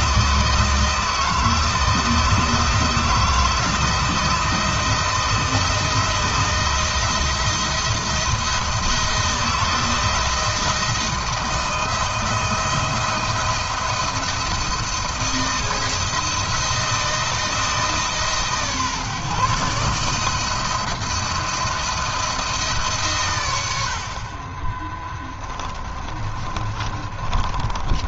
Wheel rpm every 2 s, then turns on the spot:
160, 170, 170, 170, 170, 170, 170, 170, 170, 150, 170, 130, 20, 30.
24-28